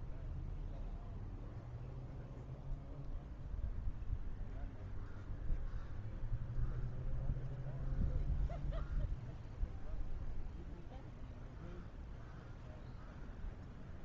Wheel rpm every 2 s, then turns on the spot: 0, 0, 0, 0, 0, 0, 0.
none